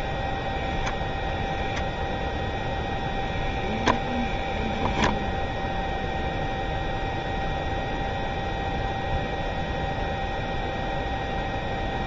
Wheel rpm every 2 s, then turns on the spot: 0, 0, 0, 0, 0, 0.
none